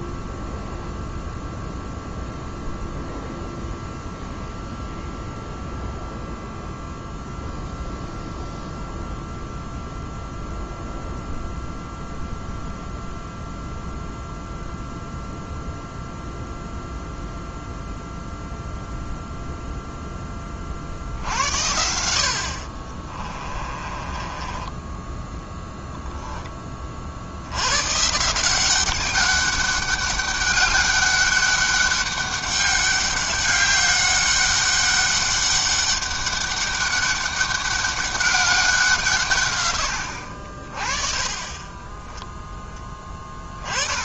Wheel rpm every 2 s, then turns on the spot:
0, 0, 0, 0, 0, 0, 0, 0, 0, 0, 50, 40, 20, 20, 190, 200, 200, 200, 200, 170, 40, 20.
22-26